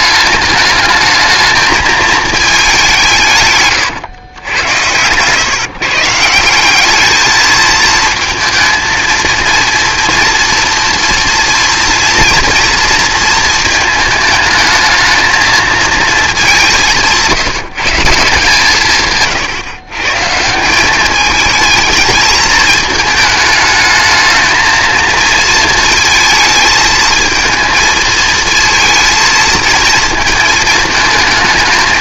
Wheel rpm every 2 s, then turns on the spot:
210, 200, 100, 180, 220, 240, 230, 220, 200, 160, 180, 210, 220, 220, 220, 220.
none